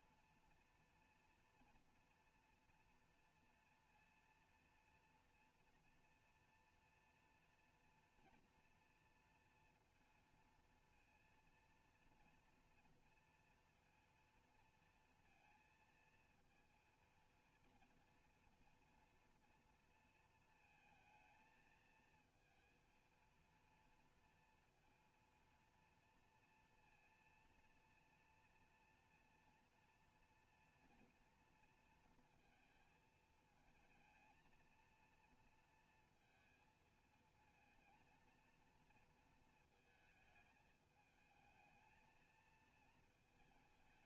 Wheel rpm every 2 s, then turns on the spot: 230, 230, 230, 230, 230, 230, 230, 230, 230, 230, 220, 230, 230, 230, 230, 230, 230, 220, 220, 230, 220, 220.
none